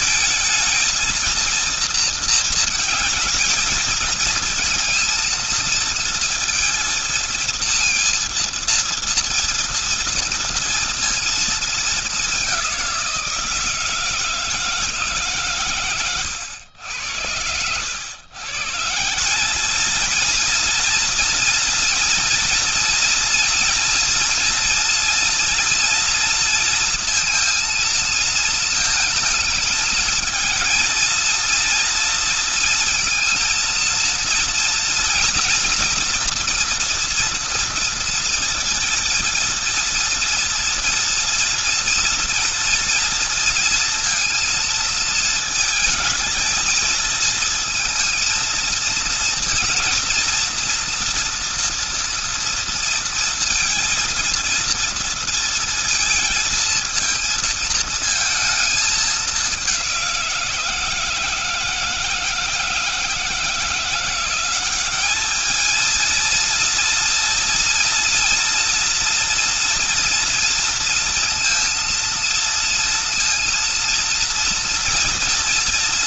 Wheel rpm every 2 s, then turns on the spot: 220, 230, 220, 230, 230, 230, 200, 160, 100, 130, 230, 230, 230, 230, 220, 220, 230, 230, 230, 230, 230, 230, 230, 220, 230, 230, 230, 230, 230, 220, 180, 160, 190, 230, 230, 230, 230, 230.
none